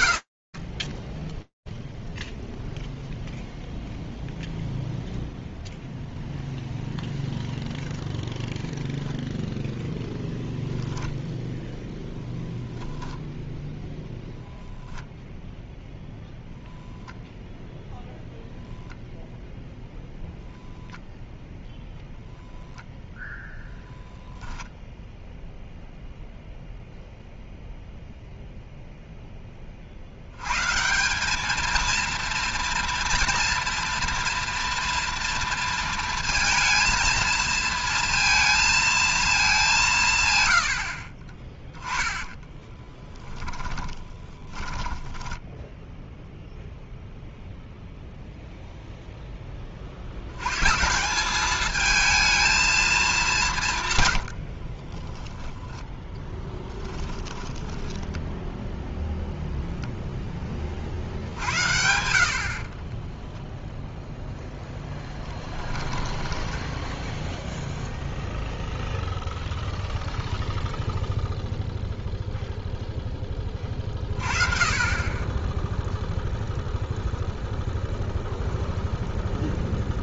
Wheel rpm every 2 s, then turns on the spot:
0, 0, 0, 0, 0, 10, 0, 0, 0, 0, 20, 0, 0, 0, 90, 230, 230, 230, 230, 130, 20, 10, 0, 0, 80, 220, 130, 10, 10, 0, 60, 0, 10, 0, 0, 0, 20, 10, 0, 0.
20-22 40-44 52-58 64-66